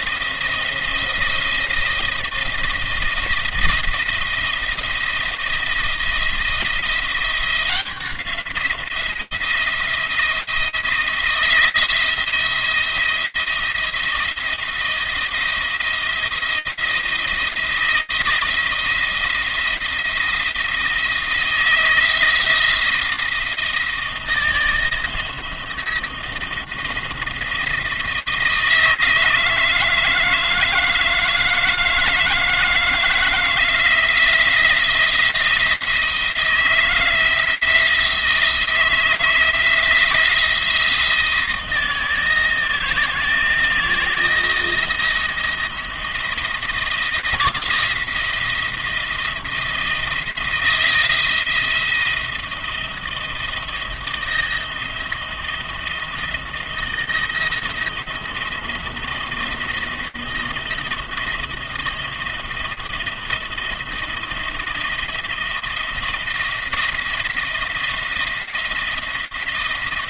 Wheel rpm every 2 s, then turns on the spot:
170, 170, 170, 170, 170, 170, 170, 170, 170, 170, 170, 170, 160, 170, 160, 160, 160, 170, 160, 160, 160, 160, 170, 170, 170, 170, 170, 170, 170, 170, 170, 170, 170, 170, 170.
none